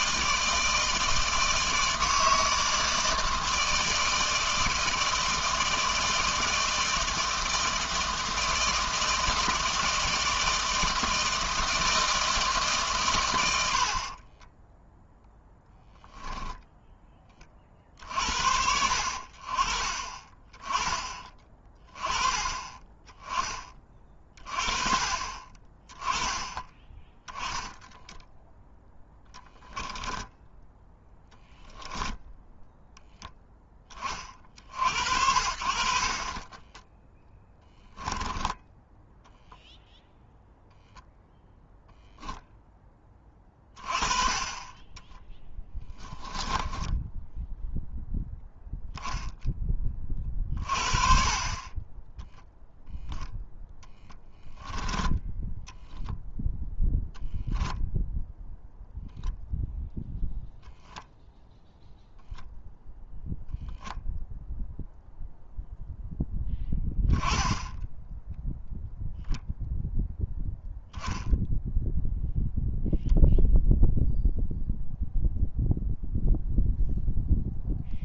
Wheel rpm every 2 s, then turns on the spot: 160, 160, 160, 160, 160, 160, 140, 10, 10, 60, 20, 20, 40, 10, 0, 10, 0, 50, 10, 10, 0, 10, 20, 10, 0, 50, 0, 10, 0, 0, 0, 0, 0, 10, 0, 0, 0, 0, 0.
14-16 30-32 36-40 46-48